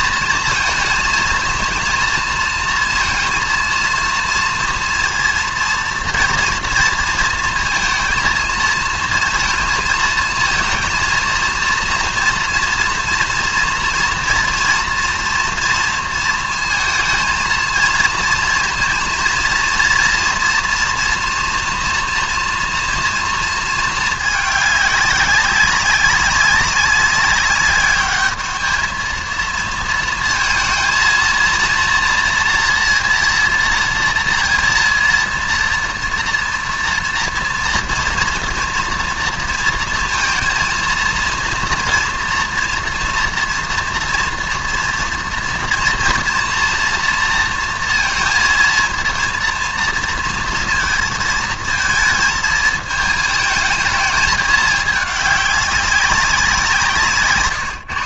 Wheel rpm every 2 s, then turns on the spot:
220, 230, 230, 230, 230, 230, 230, 230, 230, 230, 230, 240, 210, 190, 210, 230, 240, 230, 230, 230, 230, 230, 230, 240, 230, 230, 220, 210, 180.
none